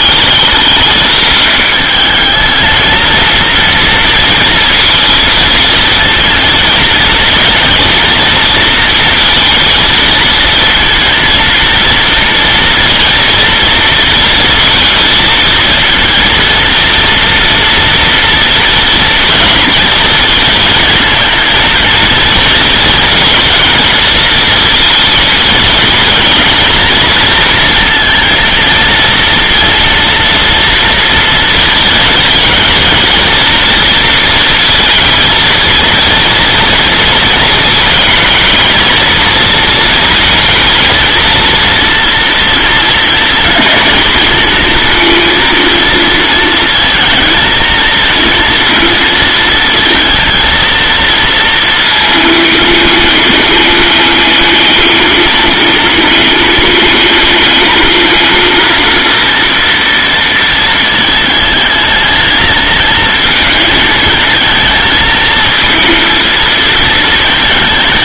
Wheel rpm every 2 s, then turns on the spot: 220, 220, 230, 230, 230, 230, 230, 230, 230, 230, 230, 230, 230, 230, 230, 230, 230, 230, 230, 230, 230, 220, 230, 230, 230, 230, 210, 220, 220, 230, 220, 220, 230, 230.
none